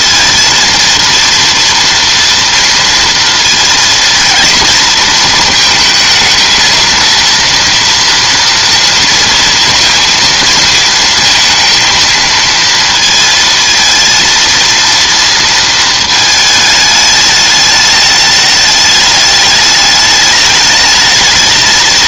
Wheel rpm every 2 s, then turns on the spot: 230, 230, 220, 230, 230, 230, 230, 230, 210, 210, 220.
none